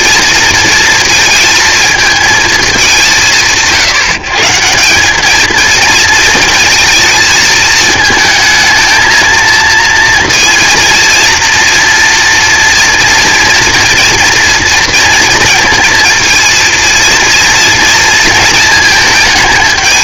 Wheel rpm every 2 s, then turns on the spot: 230, 170, 170, 230, 220, 230, 240, 230, 230, 220.
none